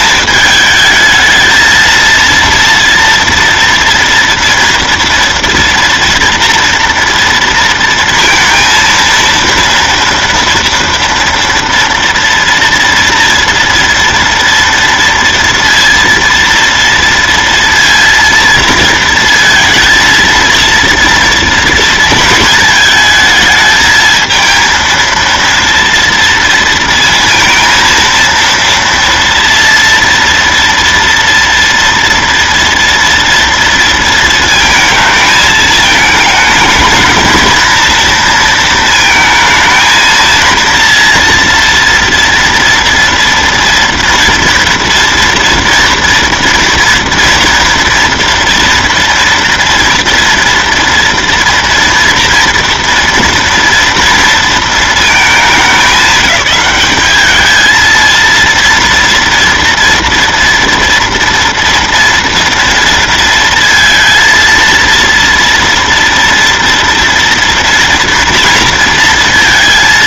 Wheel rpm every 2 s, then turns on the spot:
220, 230, 230, 230, 230, 230, 230, 230, 230, 230, 230, 220, 220, 230, 230, 230, 230, 230, 220, 230, 230, 230, 230, 230, 230, 230, 230, 230, 200, 230, 230, 240, 230, 230, 230.
none